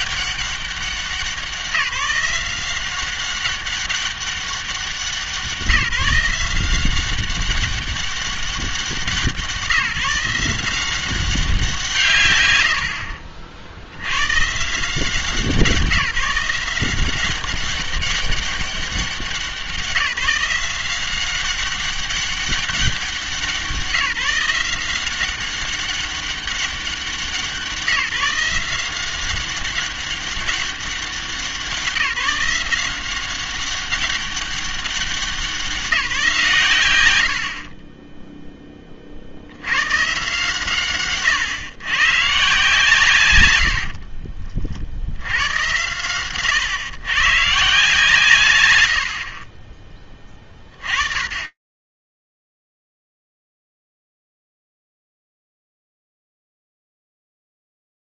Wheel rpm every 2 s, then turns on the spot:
190, 180, 190, 180, 190, 180, 90, 160, 170, 190, 180, 190, 170, 190, 170, 190, 180, 200, 140, 10, 140, 140, 50, 120, 120, 30, 0, 0, 0.
none